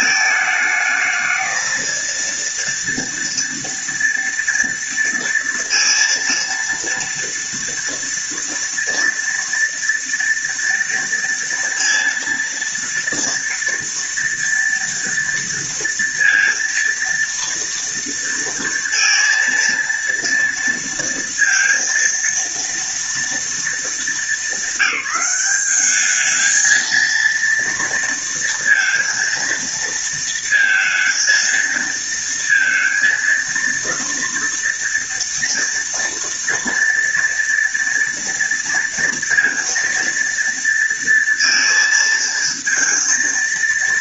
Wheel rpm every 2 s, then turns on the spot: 220, 230, 230, 230, 230, 230, 230, 230, 230, 230, 230, 230, 210, 220, 230, 230, 230, 230, 230, 230, 230, 230.
none